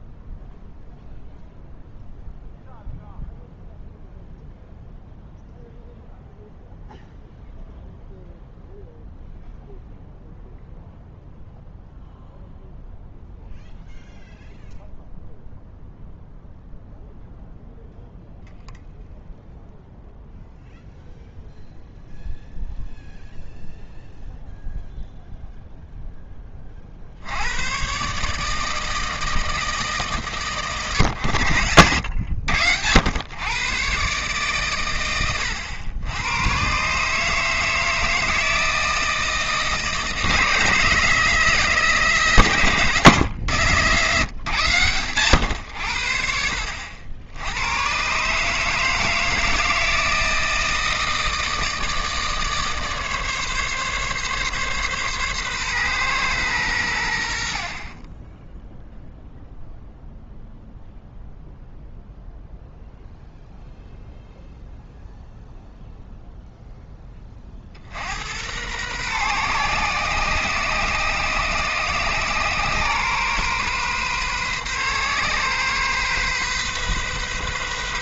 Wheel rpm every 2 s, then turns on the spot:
0, 0, 0, 0, 0, 0, 0, 0, 0, 0, 0, 0, 0, 40, 160, 110, 90, 130, 130, 160, 160, 130, 120, 60, 150, 160, 150, 140, 100, 0, 0, 0, 0, 10, 110, 130, 130, 130, 130.
none